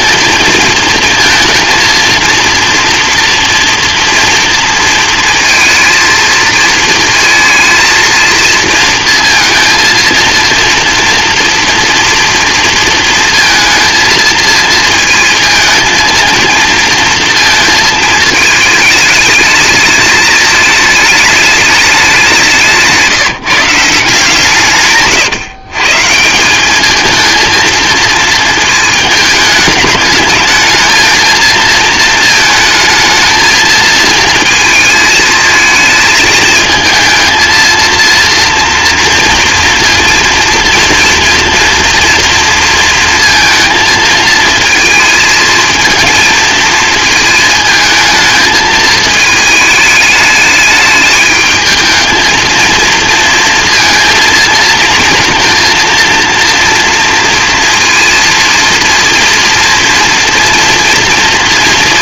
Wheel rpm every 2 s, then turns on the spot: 220, 230, 230, 230, 230, 230, 230, 220, 230, 220, 220, 170, 150, 210, 220, 220, 220, 220, 220, 230, 230, 230, 220, 220, 220, 210, 230, 230, 230, 230, 230.
none